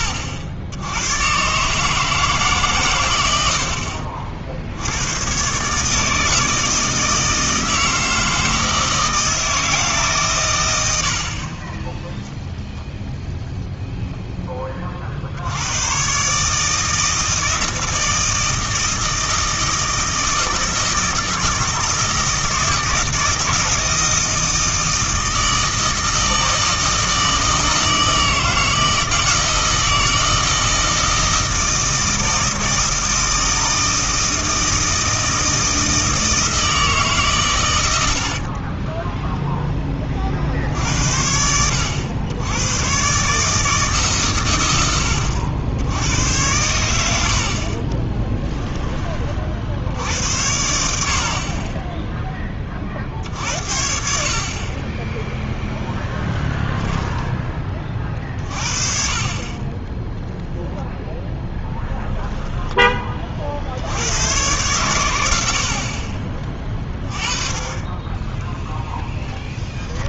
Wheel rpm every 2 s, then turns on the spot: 70, 140, 60, 160, 160, 110, 0, 20, 150, 160, 160, 160, 160, 160, 160, 160, 160, 160, 160, 30, 70, 100, 100, 100, 10, 60, 30, 40, 10, 40, 0, 10, 110, 20, 10.
38-40 56-58 68-70